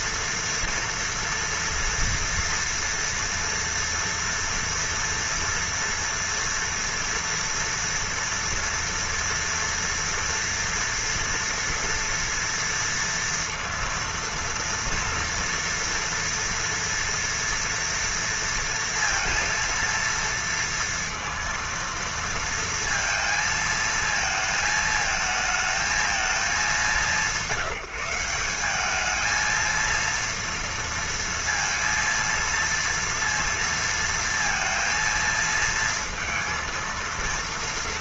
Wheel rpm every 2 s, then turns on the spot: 240, 230, 240, 230, 230, 240, 230, 230, 230, 230, 230, 230, 220, 210, 180, 230, 230, 230, 230.
none